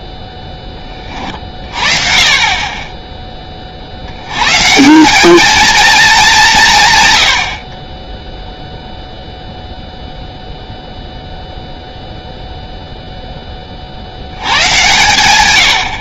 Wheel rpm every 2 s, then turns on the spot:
20, 20, 180, 120, 0, 0, 30, 80.
none